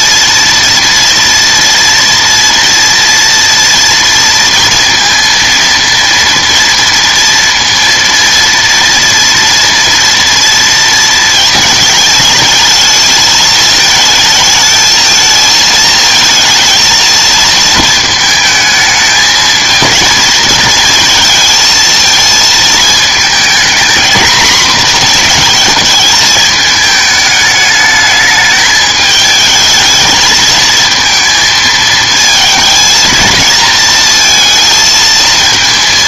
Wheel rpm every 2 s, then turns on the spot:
230, 230, 230, 230, 230, 230, 220, 220, 230, 220, 220, 220, 240, 210, 210, 220, 220, 230.
none